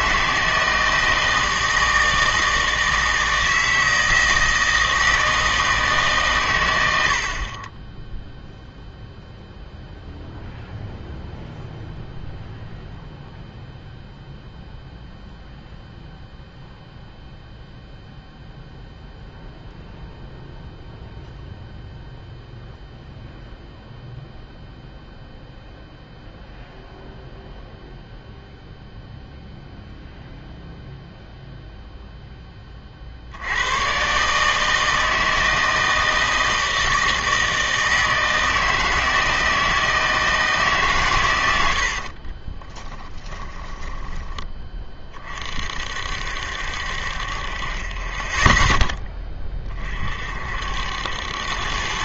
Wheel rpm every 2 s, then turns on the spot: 160, 160, 160, 100, 0, 0, 0, 0, 0, 0, 0, 0, 0, 0, 0, 0, 30, 160, 160, 160, 150, 20, 20, 60, 10, 70.
42-44